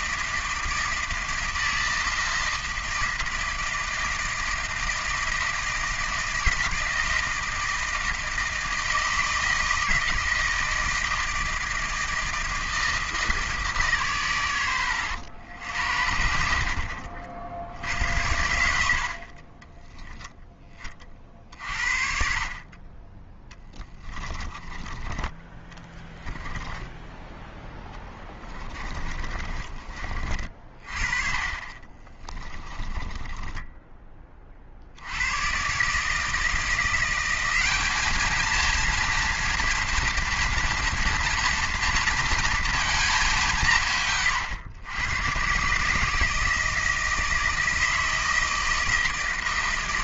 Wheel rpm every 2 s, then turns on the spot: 160, 160, 160, 160, 160, 160, 160, 110, 50, 80, 20, 40, 20, 10, 20, 30, 20, 50, 170, 230, 230, 220, 90, 160, 160.
24-30 32-34